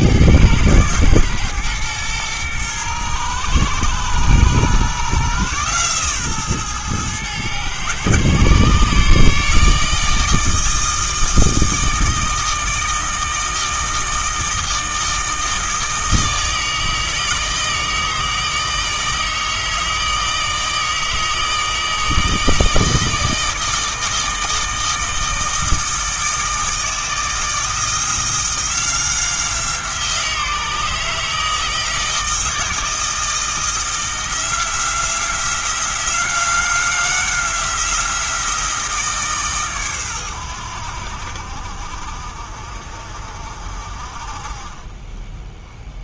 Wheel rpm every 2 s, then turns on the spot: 110, 120, 130, 120, 140, 160, 160, 160, 160, 160, 160, 160, 160, 160, 170, 160, 160, 170, 180, 160, 80, 50, 30.
none